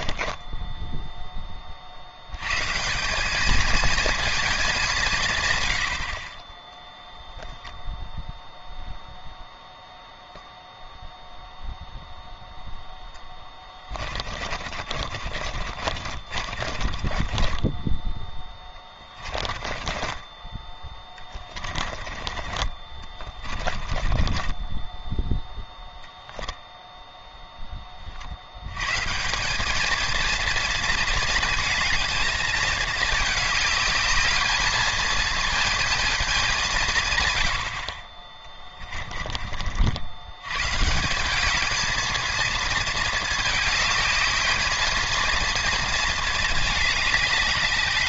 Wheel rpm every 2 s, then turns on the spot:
10, 160, 200, 10, 0, 0, 0, 40, 40, 20, 20, 20, 10, 0, 120, 230, 220, 220, 170, 30, 140, 230, 220, 210.
0-2 14-20 24-26 38-40